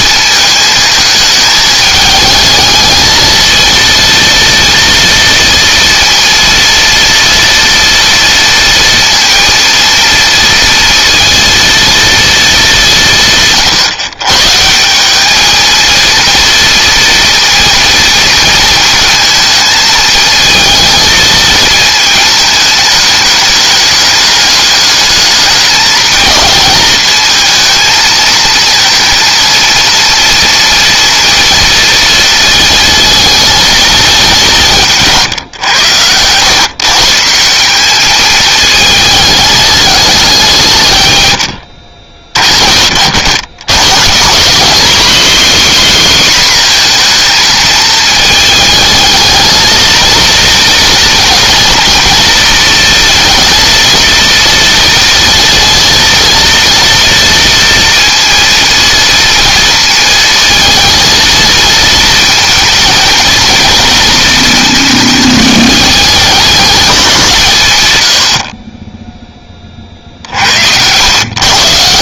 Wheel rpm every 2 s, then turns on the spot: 220, 220, 230, 230, 230, 230, 210, 170, 230, 230, 220, 210, 210, 220, 230, 230, 220, 180, 120, 220, 180, 40, 210, 240, 220, 230, 230, 230, 230, 230, 230, 230, 220, 200, 50, 90.
none